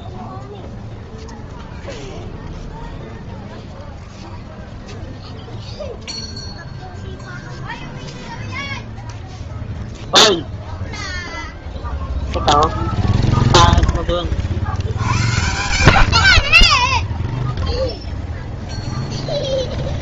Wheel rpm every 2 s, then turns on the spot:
0, 0, 0, 0, 0, 0, 40, 20, 0, 0.
none